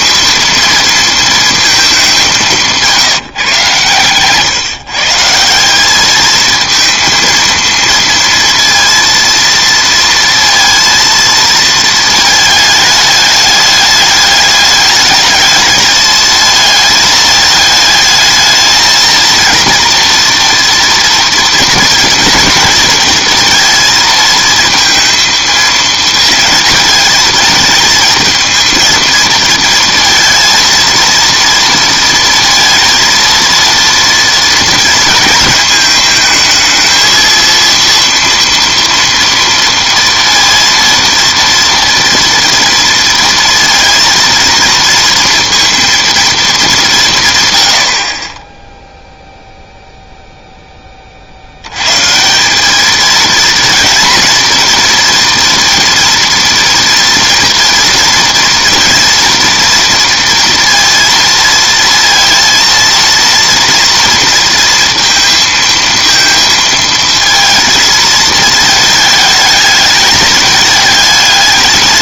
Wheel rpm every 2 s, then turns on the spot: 230, 180, 140, 220, 230, 230, 220, 210, 220, 220, 240, 240, 230, 230, 220, 230, 230, 230, 220, 230, 230, 230, 230, 200, 10, 0, 190, 230, 230, 230, 230, 230, 230, 230, 220, 220.
none